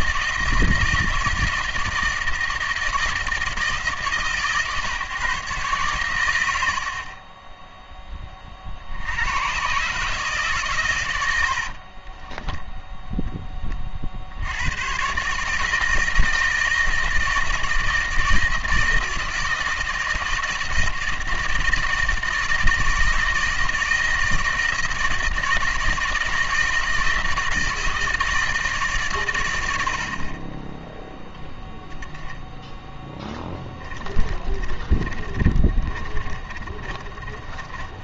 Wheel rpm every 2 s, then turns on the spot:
160, 160, 140, 50, 60, 120, 0, 120, 160, 160, 160, 160, 160, 160, 140, 10, 0, 20, 30.
34-38